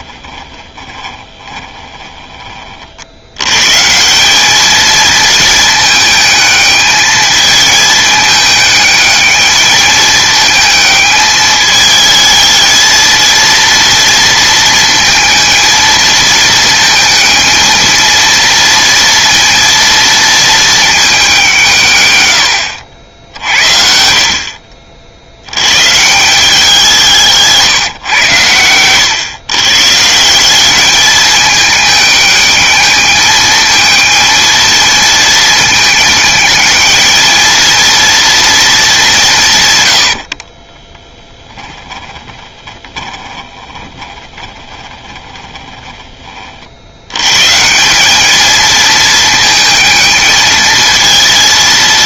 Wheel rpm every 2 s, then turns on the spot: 10, 50, 220, 220, 210, 220, 220, 230, 220, 230, 220, 80, 50, 180, 110, 210, 220, 220, 220, 210, 20, 20, 20, 70, 220, 220.
0-2 40-46